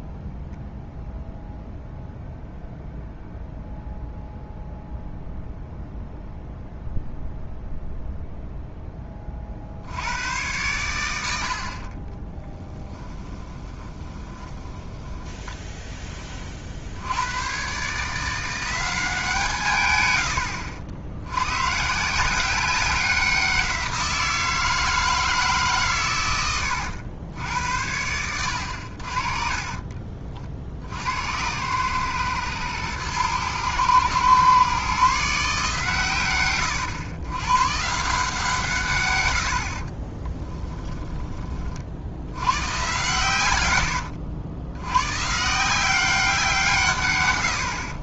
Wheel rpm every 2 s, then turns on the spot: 0, 0, 0, 0, 0, 110, 10, 20, 50, 180, 80, 190, 160, 100, 70, 60, 120, 130, 100, 140, 10, 110, 100, 150.
12-16 28-30 40-42